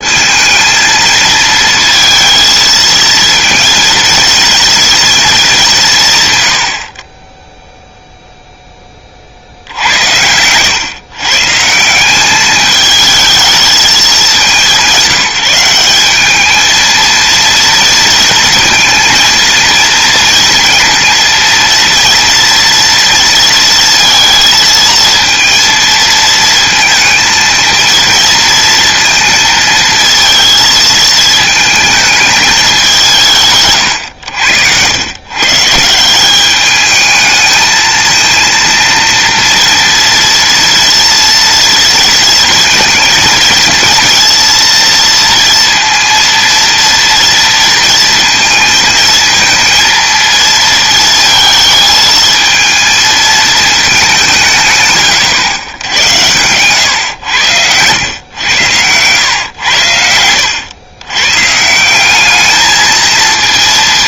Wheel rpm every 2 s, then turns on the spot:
220, 220, 220, 30, 50, 130, 220, 190, 230, 230, 230, 230, 230, 230, 230, 220, 170, 120, 220, 230, 230, 230, 230, 230, 220, 220, 220, 130, 100, 110, 120, 230.
none